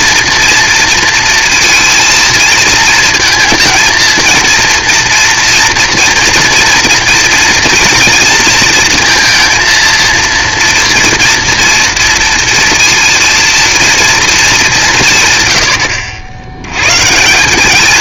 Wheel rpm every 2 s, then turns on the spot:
240, 220, 230, 230, 230, 230, 230, 200, 100.
none